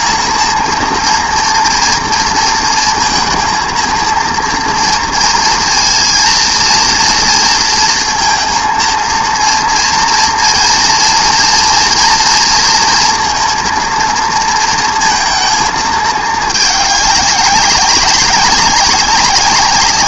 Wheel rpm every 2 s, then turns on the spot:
230, 230, 230, 230, 230, 230, 230, 230, 210, 200.
none